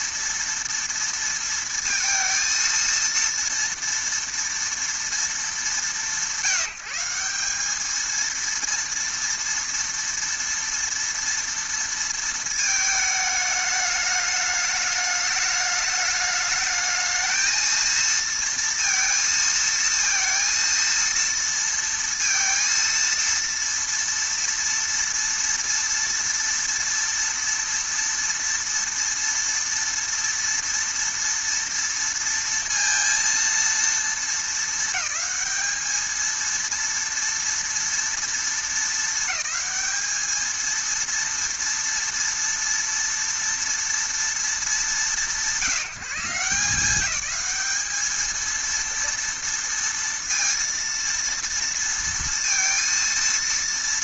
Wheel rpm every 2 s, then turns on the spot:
230, 230, 240, 180, 230, 230, 220, 210, 210, 230, 230, 230, 230, 230, 230, 230, 230, 220, 230, 230, 220, 230, 180, 190, 230, 230, 230.
none